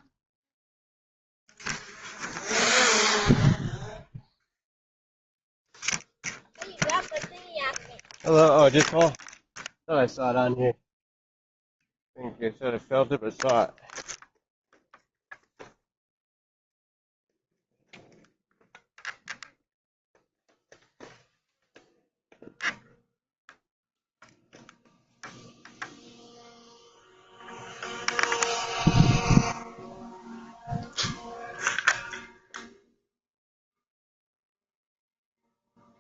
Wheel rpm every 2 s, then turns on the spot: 0, 0, 0, 0, 0, 0, 0, 0, 0, 0, 0, 0, 0, 0, 0, 0, 0, 0.
none